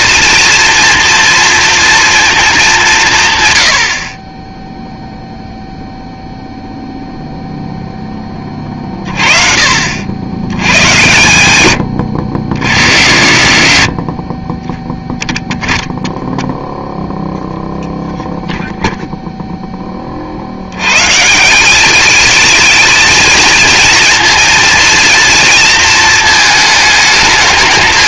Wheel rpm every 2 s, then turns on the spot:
230, 200, 10, 0, 30, 100, 50, 10, 0, 0, 100, 220, 230, 220.
none